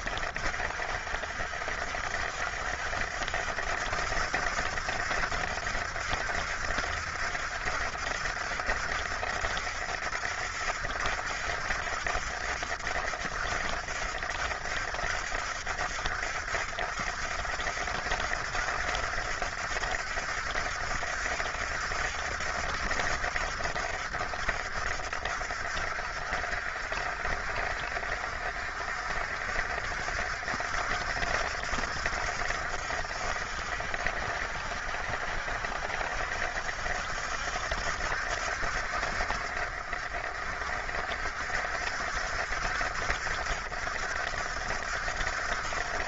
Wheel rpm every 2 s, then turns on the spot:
60, 70, 70, 70, 70, 70, 70, 70, 70, 70, 70, 70, 60, 60, 60, 70, 60, 60, 70, 60, 60, 60, 70.
none